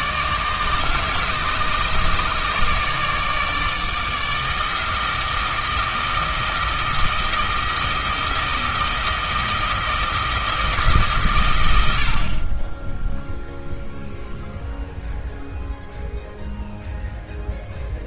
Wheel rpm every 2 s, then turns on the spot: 150, 150, 160, 160, 170, 160, 20, 0, 0.
none